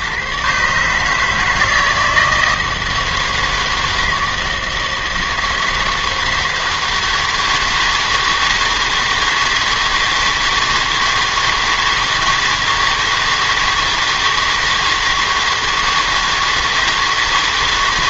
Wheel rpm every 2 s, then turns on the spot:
120, 160, 160, 160, 160, 160, 160, 160, 160.
none